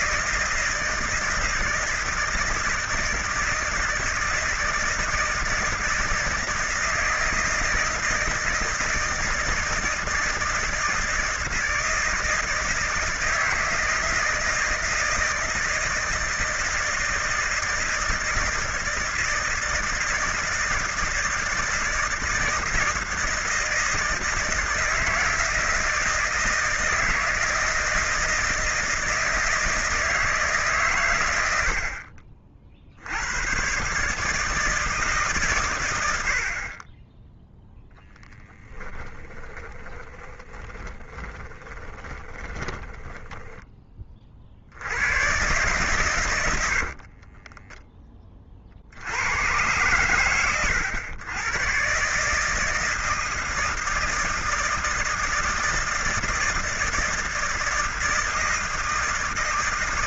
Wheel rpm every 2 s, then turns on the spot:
160, 160, 160, 160, 160, 160, 160, 160, 160, 160, 160, 160, 160, 160, 160, 130, 70, 160, 20, 10, 20, 10, 90, 60, 70, 100, 160, 160, 160, 160.
38-44 46-48